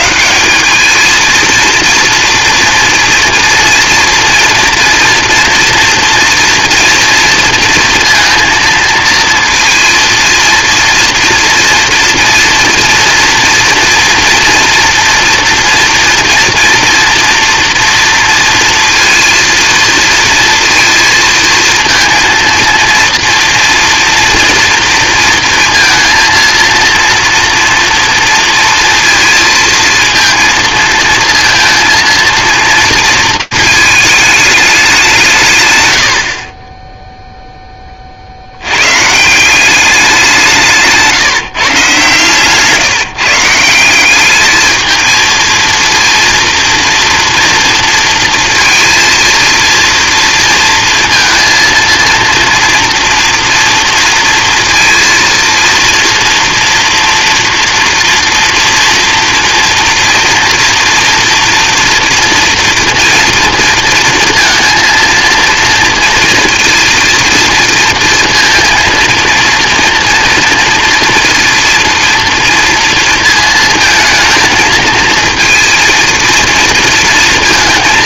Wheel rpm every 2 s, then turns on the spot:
200, 230, 230, 230, 230, 230, 230, 230, 230, 230, 230, 230, 230, 230, 230, 230, 230, 200, 20, 100, 160, 150, 220, 230, 230, 230, 230, 230, 230, 240, 230, 240, 230, 230, 230, 230, 230, 230, 230.
none